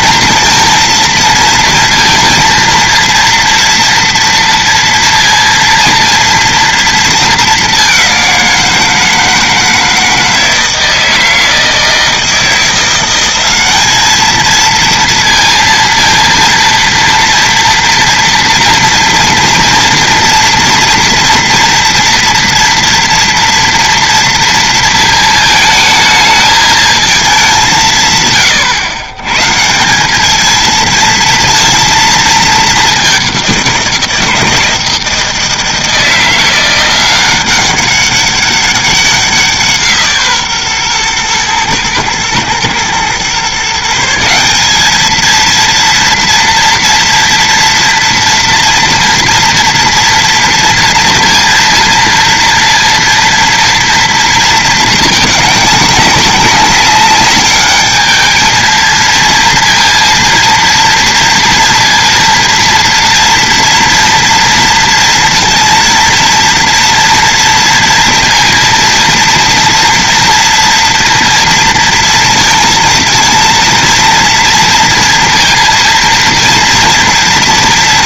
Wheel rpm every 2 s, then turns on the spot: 230, 230, 230, 230, 170, 160, 170, 230, 230, 230, 240, 230, 230, 220, 120, 230, 210, 160, 170, 190, 130, 120, 200, 230, 230, 230, 230, 220, 200, 220, 230, 230, 230, 230, 230, 230, 230, 230, 230.
none